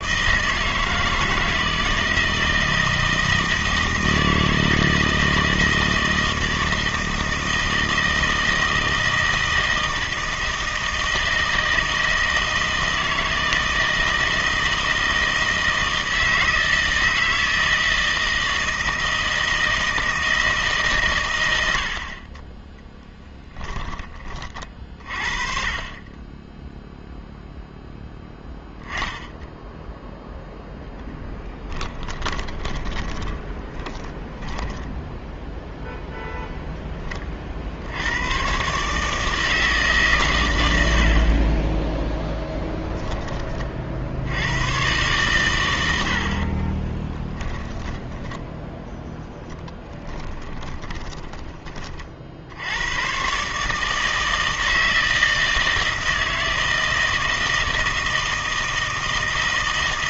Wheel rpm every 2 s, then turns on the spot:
160, 160, 160, 160, 160, 160, 160, 160, 160, 160, 160, 30, 30, 10, 10, 0, 20, 10, 10, 130, 100, 20, 100, 30, 10, 20, 80, 160, 160, 160.
32-36 46-48 50-52